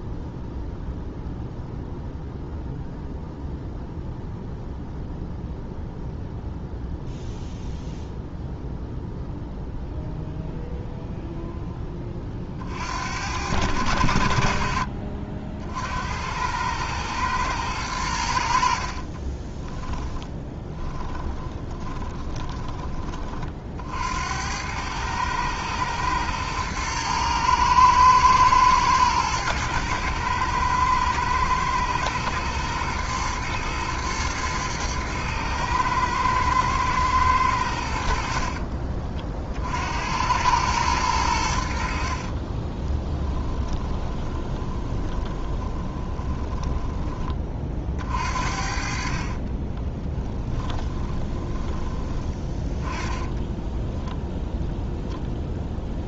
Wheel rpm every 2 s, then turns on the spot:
0, 0, 0, 0, 0, 0, 70, 50, 110, 50, 20, 20, 100, 110, 110, 110, 110, 110, 110, 40, 100, 20, 20, 20, 50, 20, 10, 0.
18-22 42-46 48-52